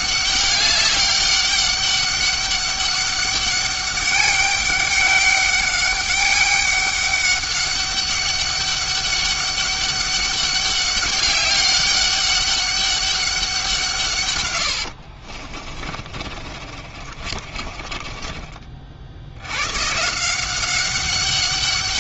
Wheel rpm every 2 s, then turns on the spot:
200, 200, 200, 200, 200, 200, 200, 80, 30, 40, 190.
14-18